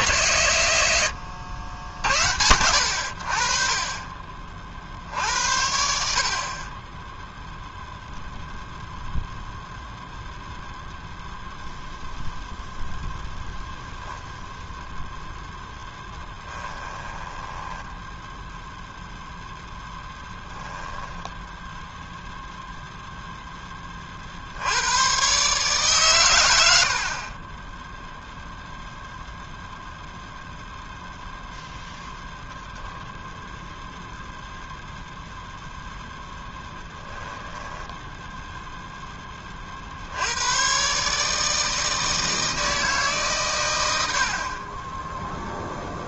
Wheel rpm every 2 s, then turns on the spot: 90, 60, 70, 10, 0, 0, 0, 0, 10, 0, 10, 0, 110, 60, 0, 0, 0, 0, 0, 0, 110, 160, 40.
16-18 20-22